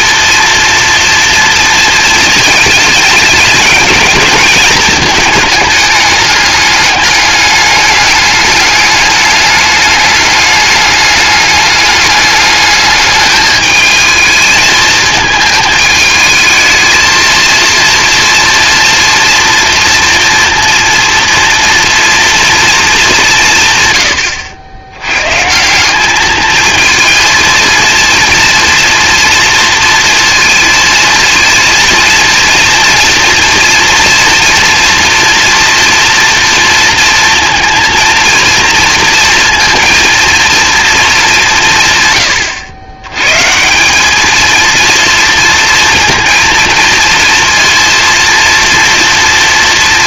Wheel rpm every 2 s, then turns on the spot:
230, 230, 220, 210, 210, 210, 210, 220, 220, 230, 230, 230, 100, 220, 240, 230, 230, 230, 230, 230, 230, 100, 230, 230, 230.
none